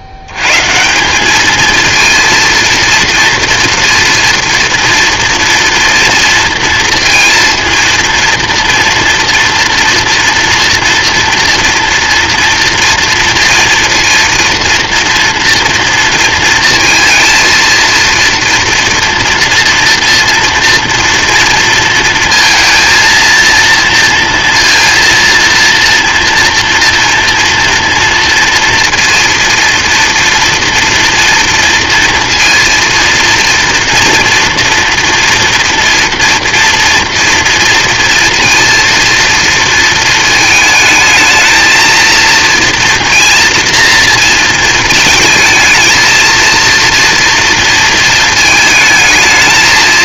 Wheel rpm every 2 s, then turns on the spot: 90, 230, 230, 230, 230, 230, 230, 230, 230, 230, 230, 230, 230, 230, 230, 240, 230, 230, 230, 230, 220, 230, 230, 230, 220.
none